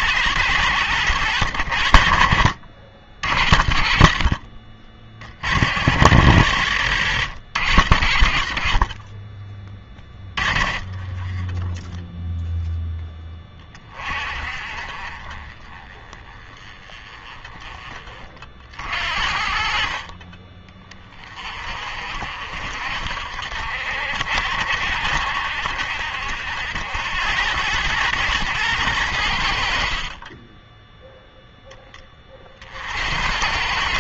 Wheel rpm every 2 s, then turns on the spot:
110, 70, 50, 100, 50, 20, 0, 40, 20, 50, 30, 60, 60, 80, 110, 10, 60.
none